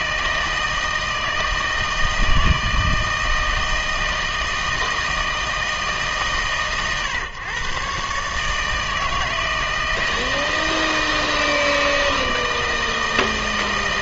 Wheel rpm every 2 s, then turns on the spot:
160, 160, 160, 130, 160, 160, 160.
none